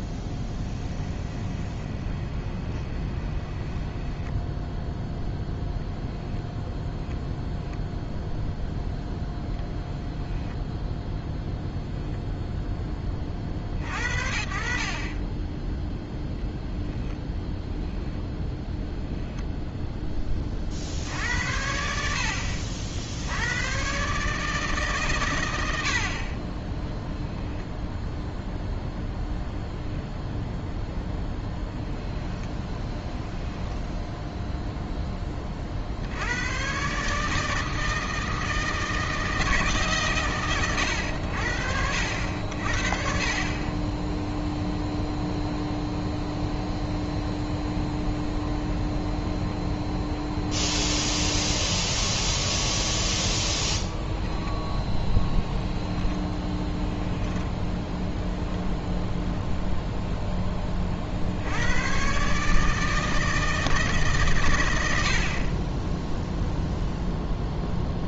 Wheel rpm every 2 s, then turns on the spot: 10, 20, 10, 0, 0, 10, 0, 50, 0, 0, 40, 60, 150, 10, 0, 0, 10, 0, 120, 160, 110, 70, 0, 0, 0, 0, 0, 10, 10, 0, 20, 160, 100, 0.
0-6 32-34 54-58